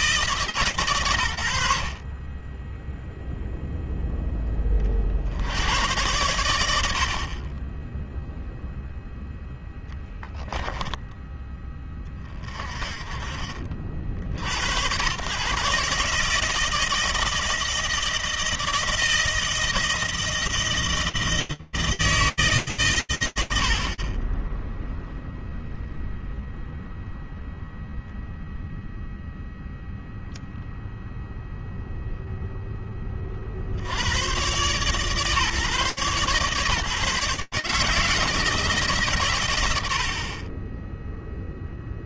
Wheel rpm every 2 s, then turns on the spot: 140, 10, 10, 100, 0, 10, 30, 110, 160, 160, 160, 130, 10, 0, 0, 0, 60, 140, 160, 100, 0.
none